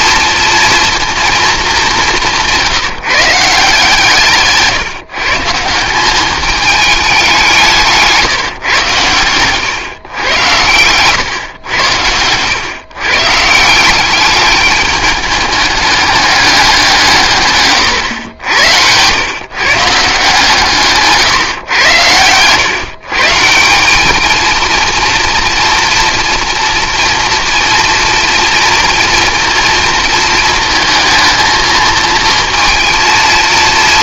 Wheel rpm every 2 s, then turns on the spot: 230, 180, 150, 210, 130, 110, 120, 210, 200, 100, 150, 130, 230, 230, 230, 220, 230.
none